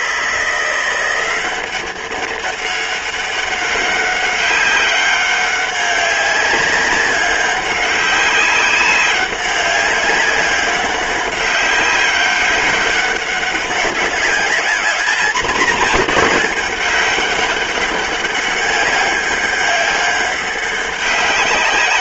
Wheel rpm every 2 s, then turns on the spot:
170, 200, 200, 200, 200, 200, 200, 210, 210, 190, 190.
none